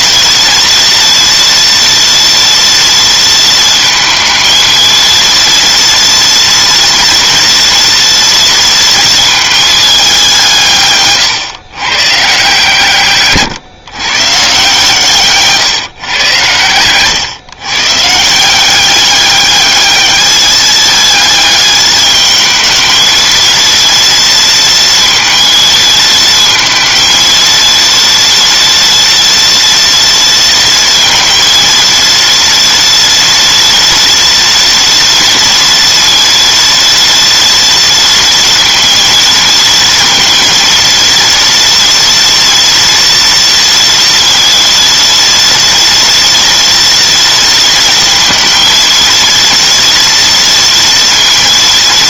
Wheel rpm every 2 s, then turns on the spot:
230, 230, 230, 230, 230, 140, 140, 140, 120, 190, 210, 220, 230, 230, 240, 230, 230, 230, 230, 230, 230, 230, 230, 230, 230, 230.
10-12 16-18